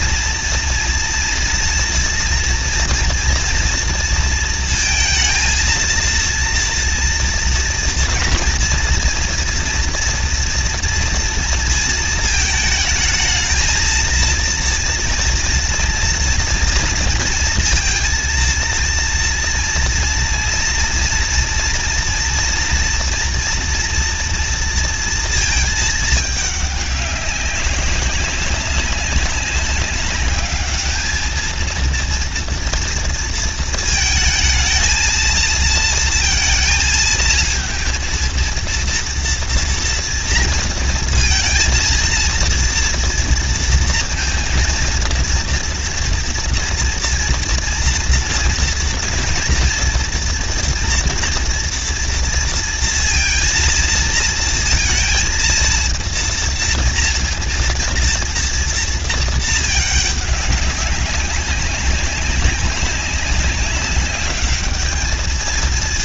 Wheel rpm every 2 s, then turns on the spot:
230, 230, 230, 240, 230, 230, 220, 230, 230, 230, 230, 230, 240, 210, 200, 210, 230, 220, 230, 230, 230, 230, 230, 230, 230, 230, 230, 230, 230, 230, 200, 190, 210.
none